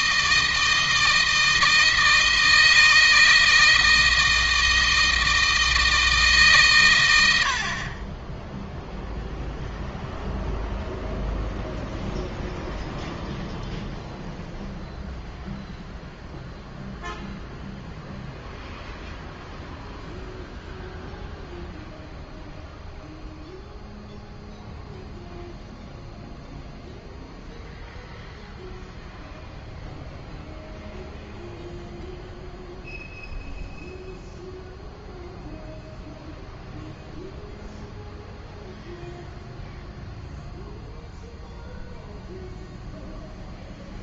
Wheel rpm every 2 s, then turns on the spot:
160, 160, 160, 120, 0, 0, 0, 0, 0, 0, 0, 0, 0, 0, 0, 0, 0, 0, 0, 0, 0, 0.
none